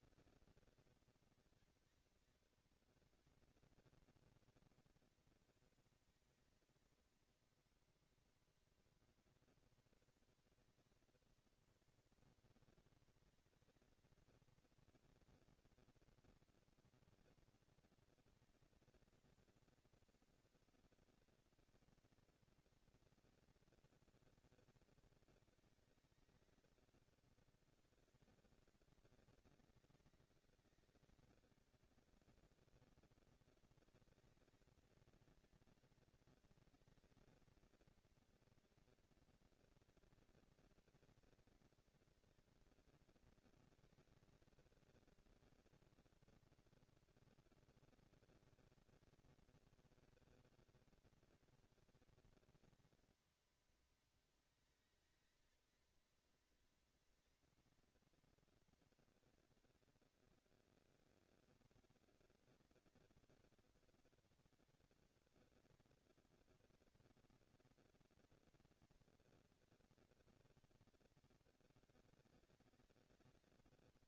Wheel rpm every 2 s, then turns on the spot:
230, 230, 230, 230, 240, 230, 230, 230, 230, 230, 230, 230, 220, 210, 190, 190, 220, 230, 230, 230, 240, 230, 230, 240, 220, 220, 230, 220, 230, 230, 230, 230, 230, 240, 240, 190, 190.
none